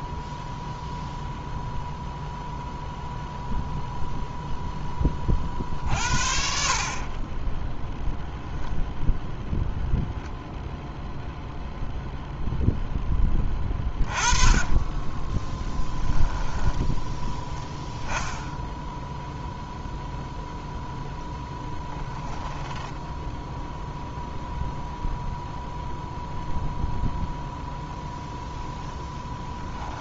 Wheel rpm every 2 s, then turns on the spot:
0, 0, 10, 40, 0, 0, 10, 20, 10, 0, 0, 10, 0, 0, 0.
14-16 22-24